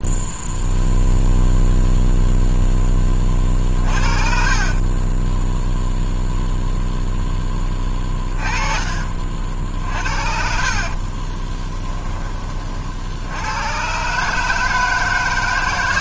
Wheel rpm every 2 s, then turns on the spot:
0, 10, 30, 0, 30, 50, 40, 160.
4-6 8-12